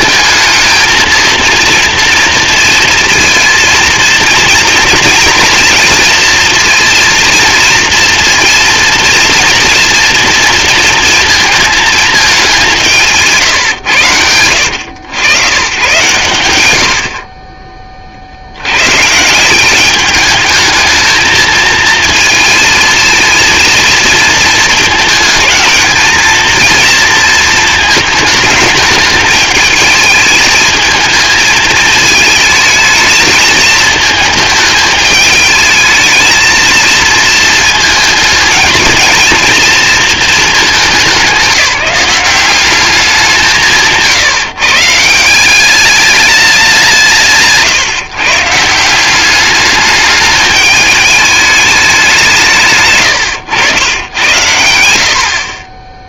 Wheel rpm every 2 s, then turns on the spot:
220, 230, 230, 230, 230, 230, 180, 90, 80, 110, 220, 220, 220, 230, 220, 220, 220, 220, 220, 230, 200, 200, 150, 190, 170, 210, 130, 100.
none